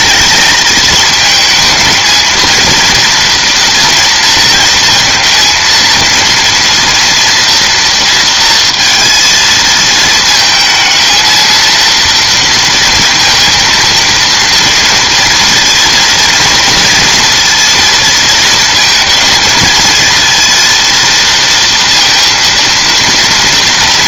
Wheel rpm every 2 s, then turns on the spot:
220, 230, 230, 230, 230, 220, 230, 230, 230, 230, 230, 230.
none